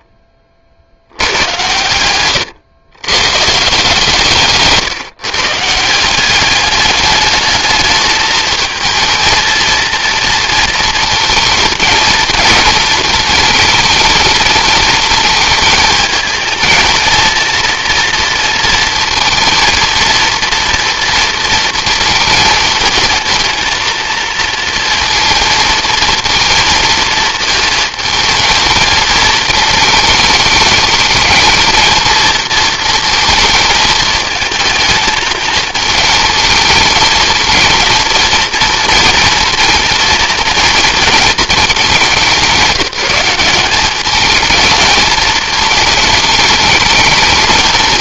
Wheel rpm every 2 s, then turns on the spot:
50, 100, 150, 200, 230, 230, 220, 220, 220, 230, 230, 230, 230, 230, 220, 210, 230, 220, 220, 230, 230, 180, 220, 220.
none